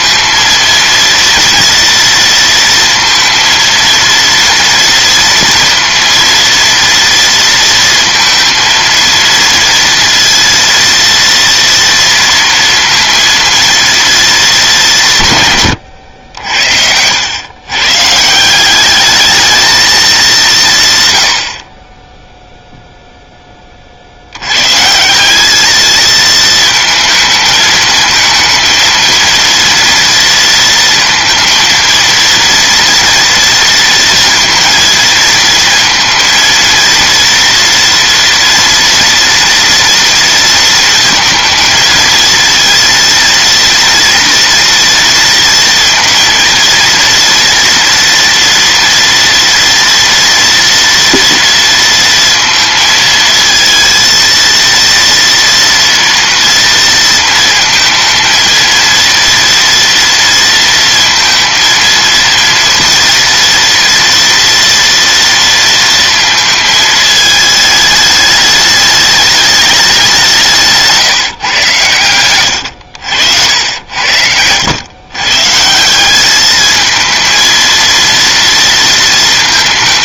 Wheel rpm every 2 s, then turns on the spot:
230, 230, 230, 230, 230, 230, 230, 140, 110, 220, 60, 0, 180, 220, 230, 230, 230, 230, 230, 230, 230, 230, 230, 230, 230, 230, 220, 230, 230, 230, 230, 230, 230, 220, 210, 160, 70, 130, 220, 230.
none